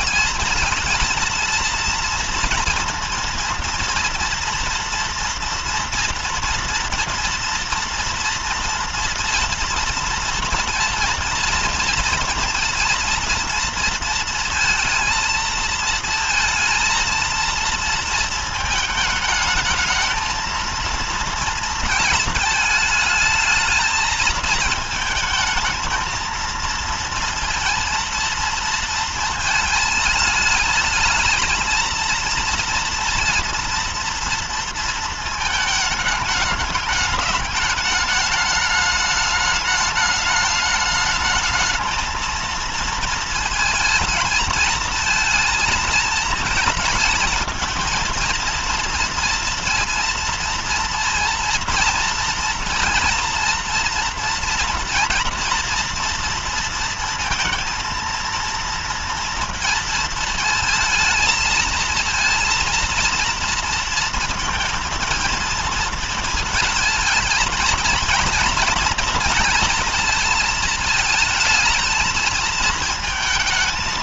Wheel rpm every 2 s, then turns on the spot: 220, 230, 230, 230, 230, 230, 230, 230, 230, 220, 220, 220, 220, 230, 230, 220, 230, 230, 210, 210, 210, 230, 230, 220, 230, 230, 230, 230, 230, 230, 220, 230, 230, 220, 230, 230, 220.
none